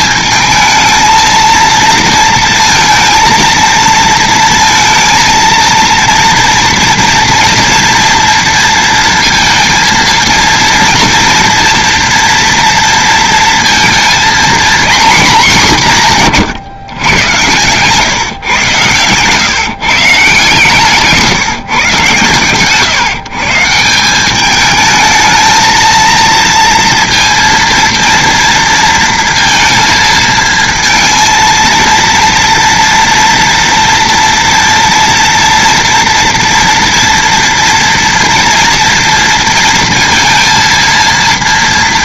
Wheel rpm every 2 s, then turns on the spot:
230, 230, 230, 240, 230, 240, 230, 240, 110, 130, 160, 130, 220, 230, 230, 230, 230, 230, 230, 230, 230.
20-22